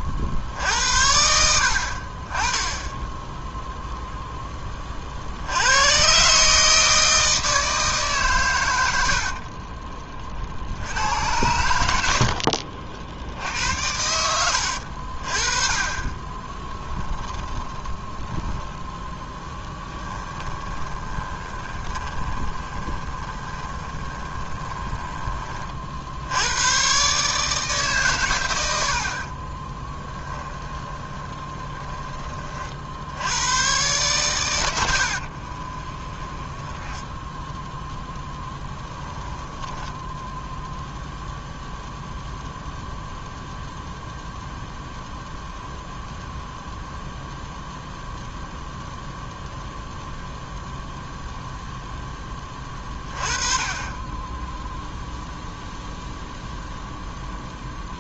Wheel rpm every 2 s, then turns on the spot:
50, 20, 10, 150, 120, 50, 60, 80, 10, 10, 10, 20, 20, 110, 100, 20, 40, 100, 20, 10, 0, 0, 0, 0, 0, 0, 20, 10, 0.
12-14 16-18 20-26 30-32 36-40